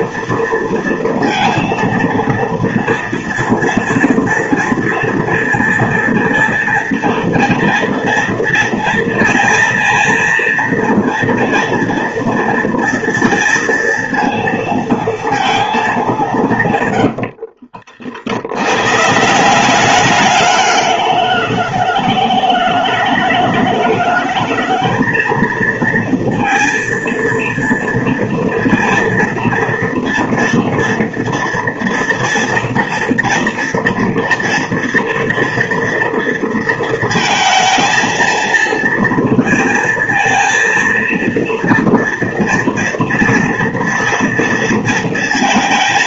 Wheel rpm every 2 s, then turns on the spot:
230, 230, 230, 230, 230, 230, 230, 230, 130, 120, 210, 210, 220, 230, 230, 230, 230, 230, 220, 230, 230, 230, 230.
16-18